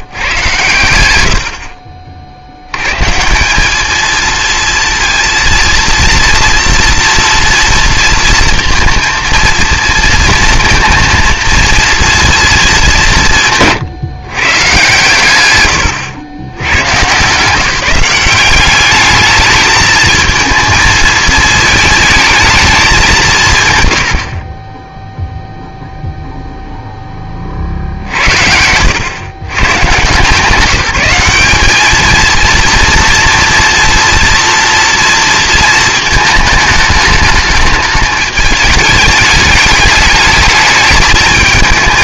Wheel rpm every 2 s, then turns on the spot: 120, 60, 230, 230, 230, 230, 220, 130, 110, 200, 220, 220, 40, 0, 70, 180, 230, 230, 220, 210, 210.
24-26